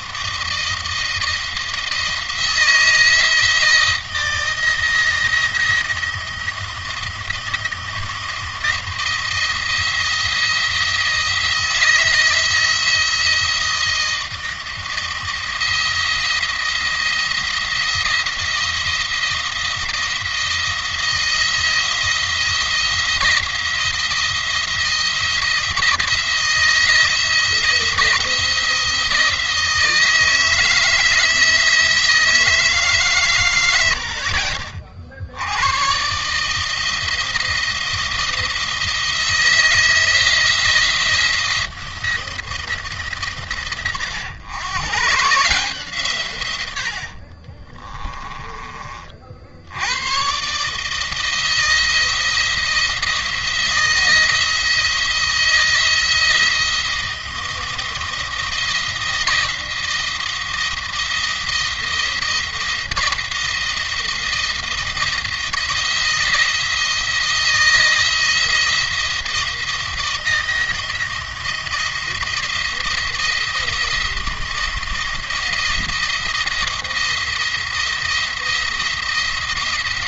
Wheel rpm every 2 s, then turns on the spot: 170, 160, 170, 170, 170, 170, 170, 170, 170, 170, 170, 170, 170, 160, 170, 160, 160, 60, 160, 170, 160, 160, 120, 100, 30, 140, 160, 160, 160, 170, 170, 170, 170, 170, 160, 170, 170, 170, 170, 170.
none